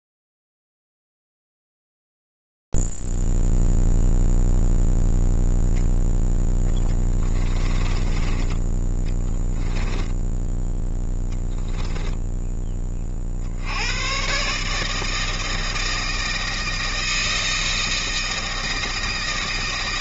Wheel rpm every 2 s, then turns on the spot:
0, 0, 0, 0, 10, 10, 10, 130, 160, 160.
10-12